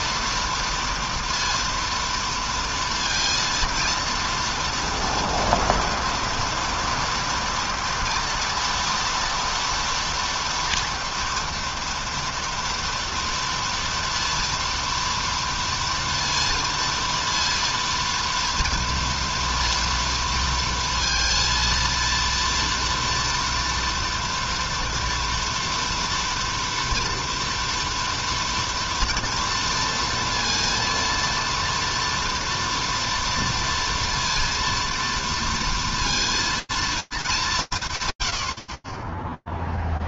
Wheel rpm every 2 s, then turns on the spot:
230, 230, 230, 230, 230, 230, 230, 230, 230, 230, 230, 230, 240, 230, 230, 230, 230, 230, 230, 30.
none